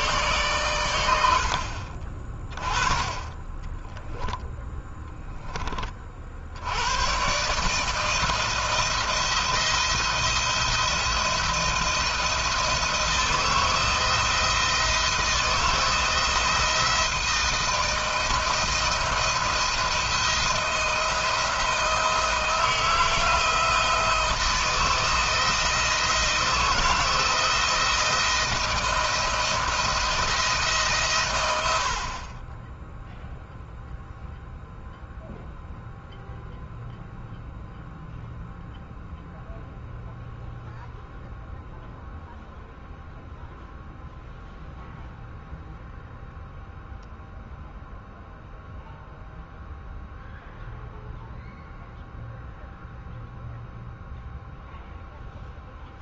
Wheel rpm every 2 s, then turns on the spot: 110, 20, 10, 90, 160, 170, 160, 170, 160, 170, 170, 160, 160, 160, 170, 150, 10, 0, 0, 0, 0, 0, 0, 0, 0, 0, 0, 0.
none